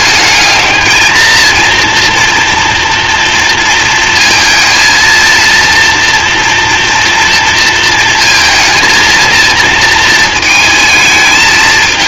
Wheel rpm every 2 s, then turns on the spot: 220, 230, 220, 230, 230, 220.
none